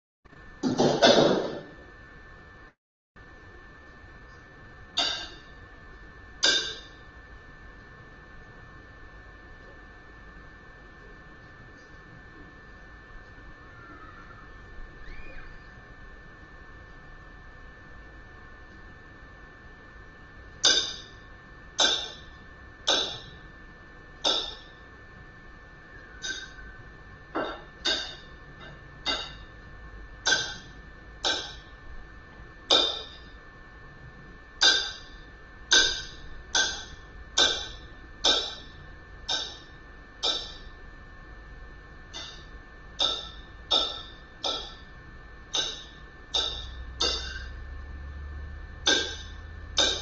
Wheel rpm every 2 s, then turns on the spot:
0, 0, 0, 0, 0, 0, 0, 0, 0, 0, 0, 0, 0, 0, 0, 0, 0, 0, 0, 0, 0, 0, 0, 0, 0.
none